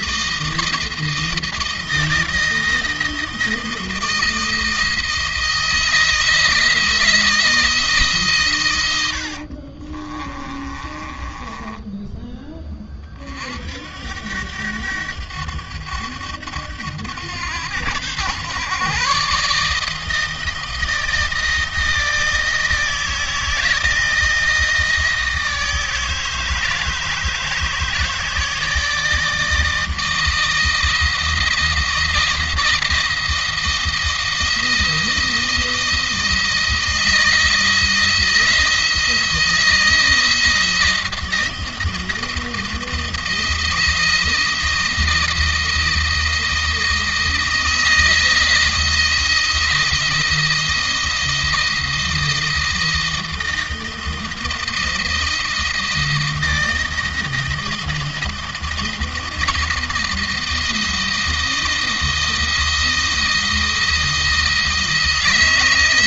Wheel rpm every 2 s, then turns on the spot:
160, 160, 160, 160, 120, 30, 30, 90, 100, 120, 160, 160, 160, 160, 160, 160, 160, 170, 160, 170, 160, 160, 160, 160, 170, 170, 170, 160, 170, 170, 170, 160, 160.
10-12